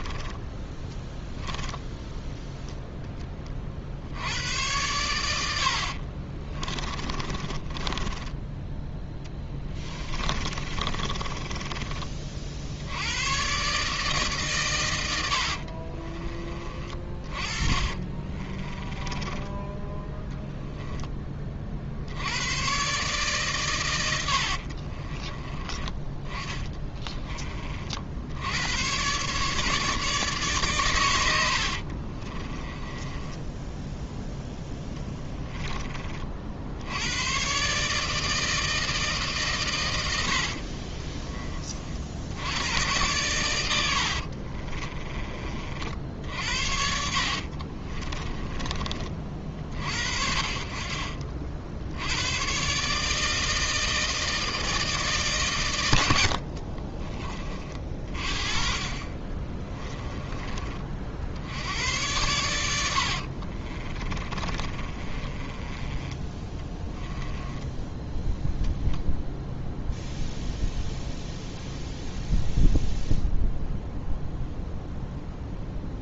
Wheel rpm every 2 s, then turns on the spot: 10, 0, 100, 20, 10, 30, 60, 120, 30, 40, 10, 120, 60, 20, 100, 130, 20, 10, 70, 160, 50, 90, 40, 60, 30, 40, 130, 160, 50, 30, 30, 80, 30, 10, 0, 0, 0, 0.
0-2 6-8 10-12 18-20 24-28 32-36 40-42 44-48 56-58 62-68